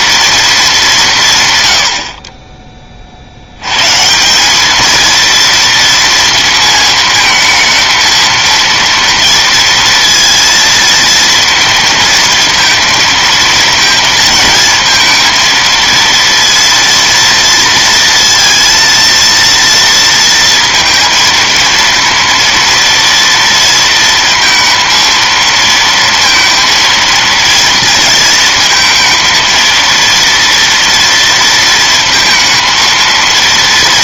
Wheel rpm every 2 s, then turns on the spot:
160, 50, 220, 220, 230, 230, 230, 230, 230, 230, 220, 230, 230, 230, 230, 230, 230.
none